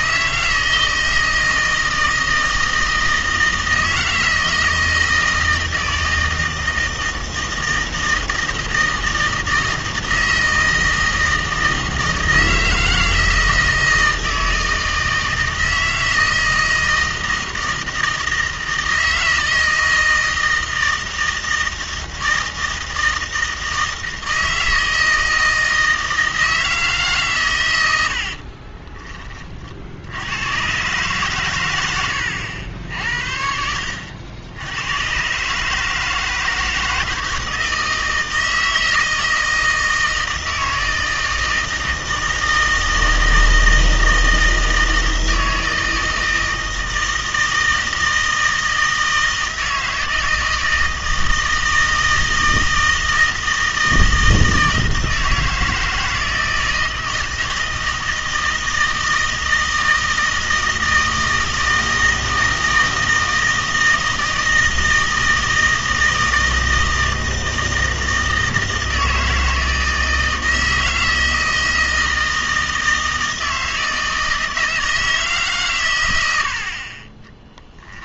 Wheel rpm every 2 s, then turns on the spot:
160, 160, 160, 160, 160, 160, 160, 160, 160, 160, 160, 160, 160, 160, 40, 120, 70, 90, 160, 160, 160, 160, 160, 160, 160, 160, 160, 160, 160, 160, 160, 160, 160, 160, 160, 160, 160, 160, 50.
28-30